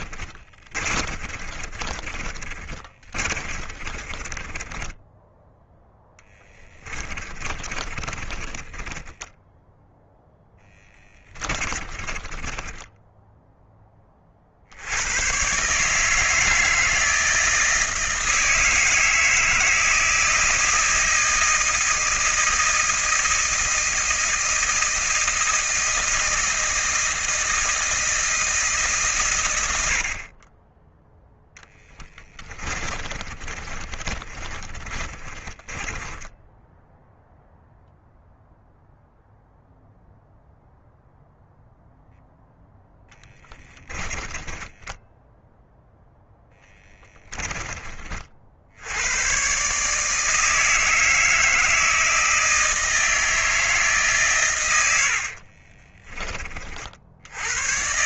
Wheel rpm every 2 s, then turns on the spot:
40, 30, 20, 20, 30, 10, 10, 70, 160, 160, 160, 160, 160, 160, 150, 10, 30, 30, 10, 0, 0, 10, 10, 20, 90, 160, 160, 100, 60.
0-14 32-36 44-48